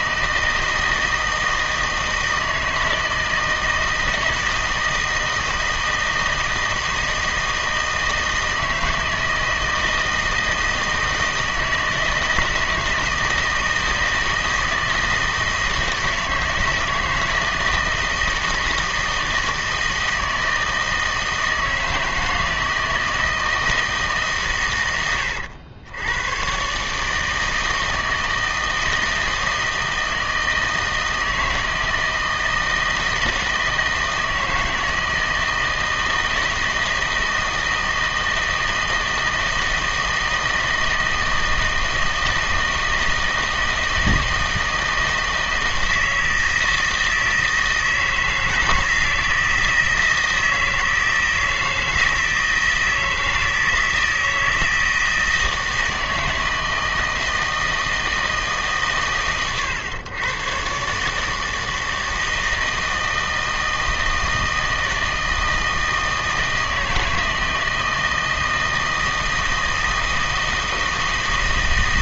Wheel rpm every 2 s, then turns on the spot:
160, 160, 160, 160, 160, 160, 160, 160, 160, 160, 160, 160, 110, 130, 160, 160, 160, 160, 160, 160, 160, 160, 160, 160, 160, 160, 160, 160, 160, 140, 130, 160, 160, 160, 160, 160.
none